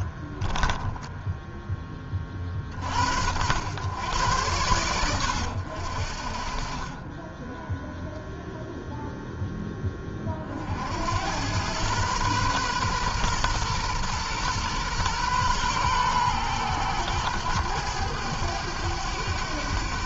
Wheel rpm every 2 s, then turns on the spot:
10, 50, 100, 40, 0, 60, 120, 120, 110, 100.
0-2